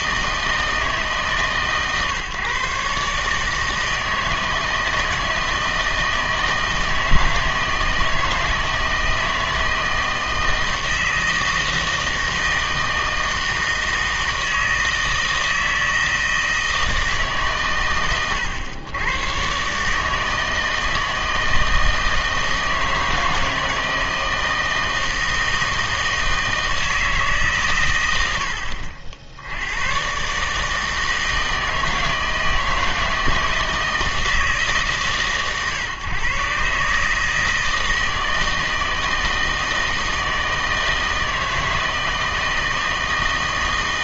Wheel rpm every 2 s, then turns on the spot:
160, 130, 160, 160, 160, 160, 160, 160, 160, 110, 160, 160, 160, 160, 80, 150, 160, 150, 130, 160, 160, 160.
none